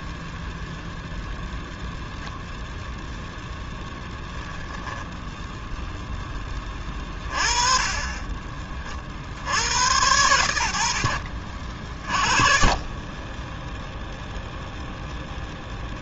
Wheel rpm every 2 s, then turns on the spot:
0, 10, 0, 30, 100, 40, 0, 0.
2-4